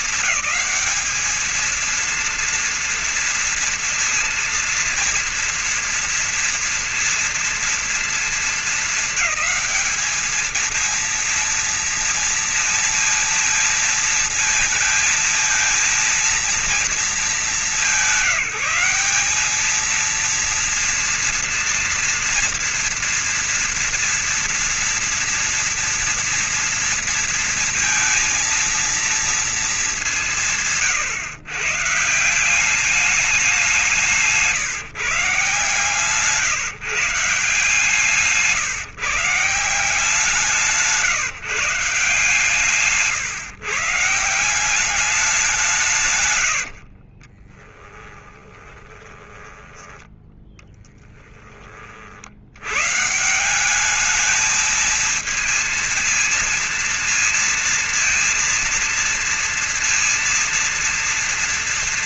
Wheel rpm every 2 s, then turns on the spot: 220, 230, 230, 230, 210, 220, 230, 220, 220, 190, 230, 230, 240, 230, 230, 180, 180, 160, 150, 160, 170, 150, 180, 100, 20, 10, 90, 220, 230, 230, 230.
40-42 46-52